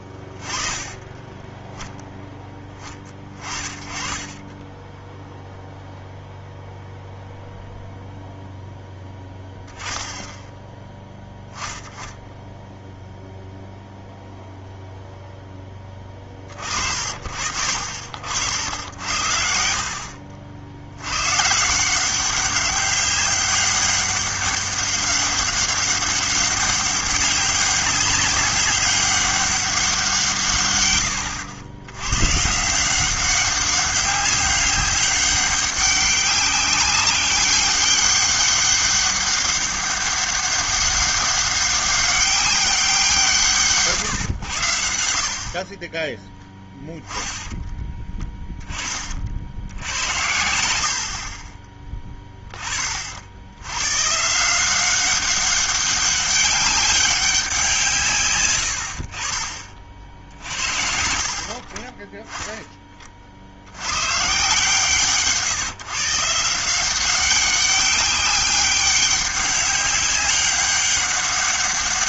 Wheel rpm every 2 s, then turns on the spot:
20, 10, 10, 0, 0, 10, 10, 0, 50, 70, 70, 190, 200, 200, 200, 130, 160, 200, 200, 200, 200, 200, 90, 10, 20, 80, 30, 170, 200, 100, 70, 10, 140, 170, 200, 200.
46-48